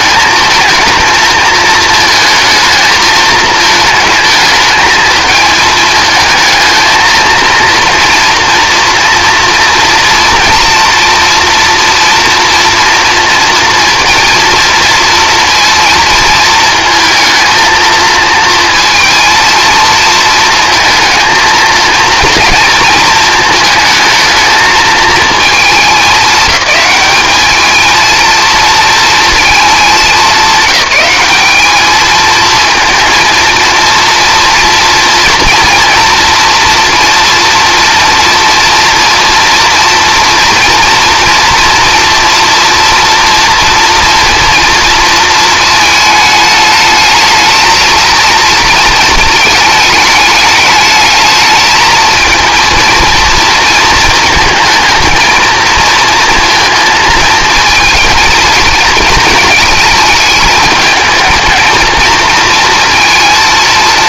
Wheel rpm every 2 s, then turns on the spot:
230, 220, 220, 230, 240, 230, 230, 230, 220, 220, 230, 220, 220, 210, 230, 190, 220, 230, 230, 230, 230, 230, 230, 220, 230, 210, 230, 220, 230, 230, 220, 230.
none